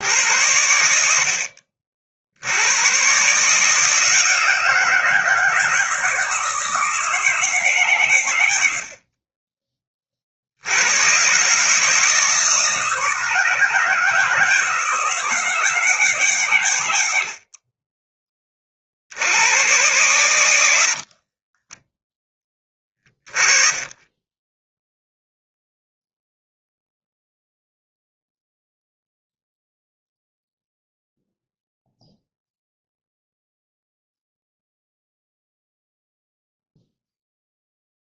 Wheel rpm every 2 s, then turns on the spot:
100, 100, 160, 170, 80, 90, 160, 160, 120, 40, 70, 20, 10, 0, 0, 0, 0, 0, 0.
20-22